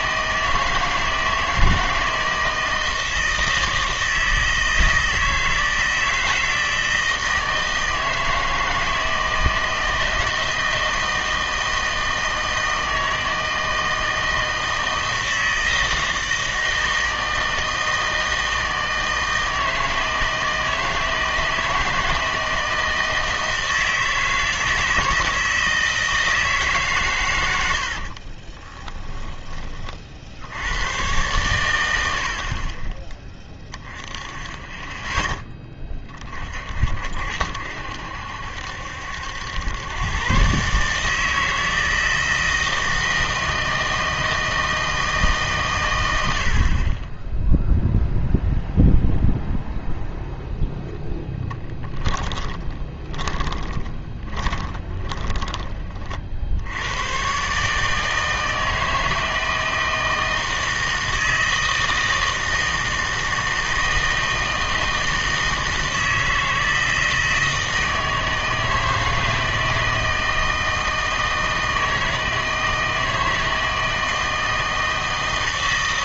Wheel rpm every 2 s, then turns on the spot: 160, 160, 160, 160, 160, 160, 160, 160, 160, 160, 160, 160, 160, 160, 20, 90, 40, 10, 50, 70, 140, 160, 160, 40, 0, 0, 20, 20, 80, 160, 160, 160, 160, 160, 160, 160, 160, 160.
28-30 52-56